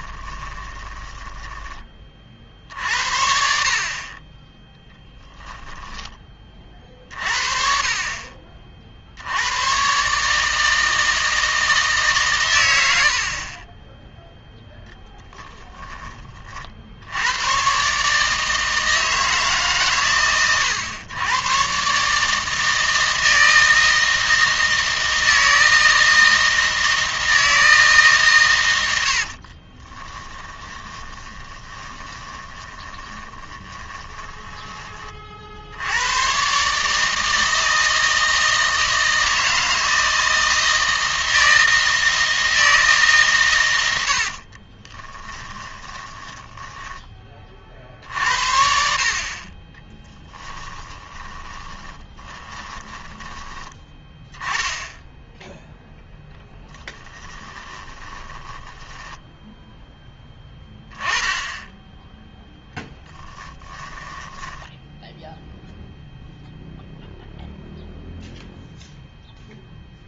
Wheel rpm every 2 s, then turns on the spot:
10, 60, 10, 40, 40, 160, 100, 0, 50, 160, 110, 160, 160, 160, 100, 20, 20, 20, 150, 160, 160, 160, 30, 10, 70, 20, 20, 10, 10, 10, 10, 10, 10, 0, 0.
0-2 4-6 30-34 44-48 50-54 56-60 62-66